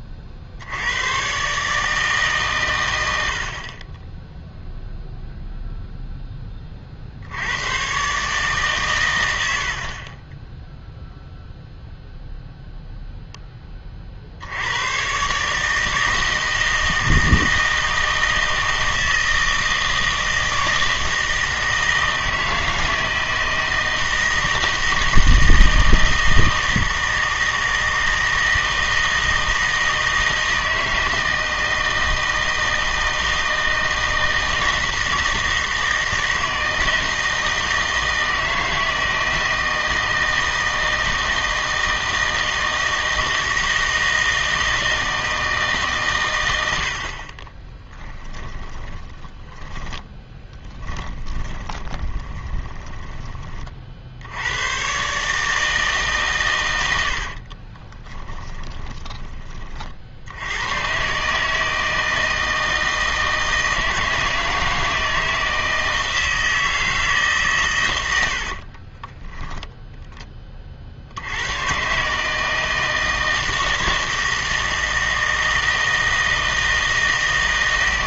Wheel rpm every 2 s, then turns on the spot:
80, 110, 0, 40, 140, 0, 0, 100, 160, 160, 160, 160, 160, 160, 160, 160, 160, 160, 160, 160, 160, 160, 160, 80, 10, 20, 20, 110, 90, 20, 110, 160, 160, 160, 30, 40, 160, 160, 160.
48-54 58-60 68-70